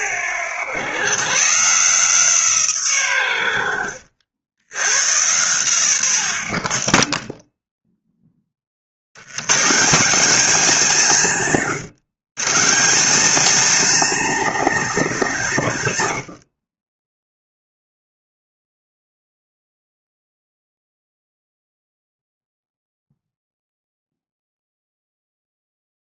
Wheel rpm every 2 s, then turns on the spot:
110, 140, 80, 60, 30, 220, 170, 260, 60, 0, 0, 0, 0.
6-8